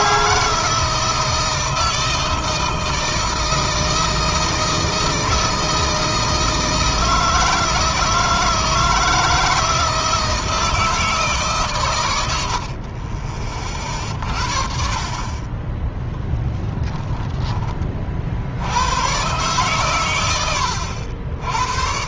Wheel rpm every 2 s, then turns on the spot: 160, 160, 170, 160, 160, 160, 50, 50, 10, 100, 70.
16-18